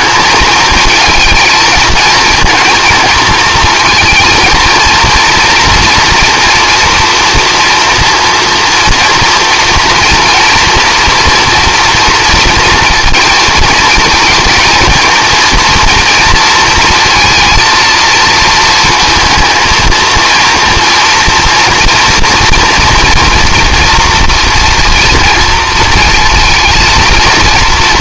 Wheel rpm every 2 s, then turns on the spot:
220, 230, 230, 230, 230, 230, 230, 220, 230, 220, 230, 230, 230, 220.
none